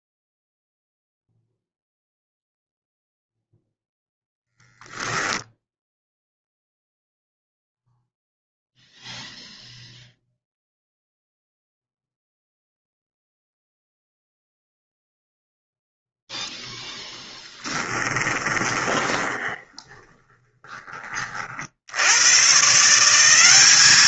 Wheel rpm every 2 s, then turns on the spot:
0, 0, 0, 0, 0, 0, 0, 0, 10, 20, 30, 160.
18-22